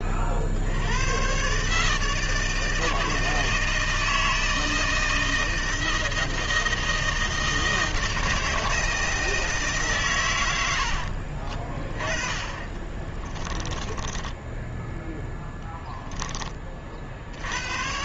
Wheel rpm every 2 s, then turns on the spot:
80, 160, 160, 160, 160, 80, 20, 10, 30.
12-16